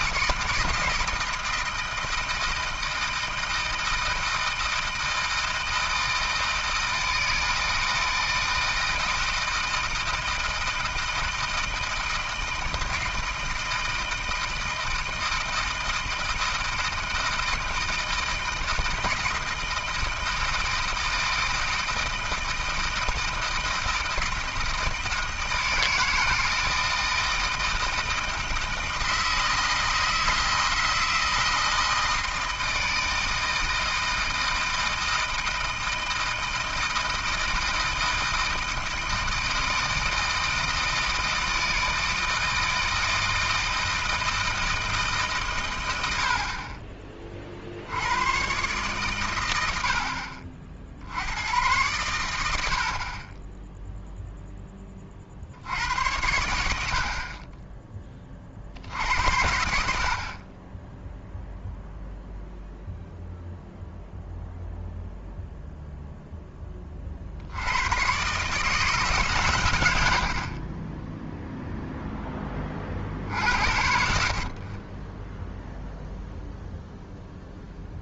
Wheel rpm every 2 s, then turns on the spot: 160, 160, 160, 160, 160, 160, 160, 160, 160, 160, 160, 160, 160, 160, 160, 160, 160, 160, 160, 160, 160, 160, 160, 30, 130, 50, 60, 10, 80, 50, 10, 0, 0, 20, 160, 50, 30, 40, 0.
none